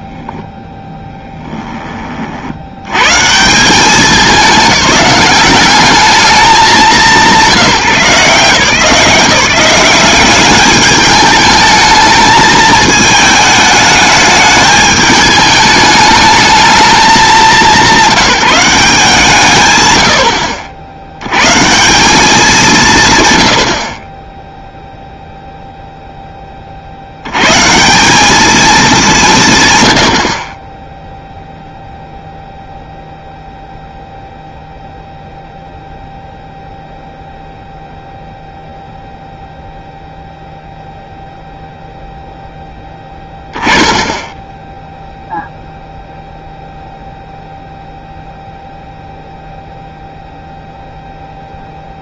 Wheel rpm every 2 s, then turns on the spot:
10, 70, 200, 190, 160, 200, 220, 210, 210, 180, 70, 180, 0, 40, 210, 10, 0, 0, 0, 0, 0, 10, 0, 0, 0, 0.
none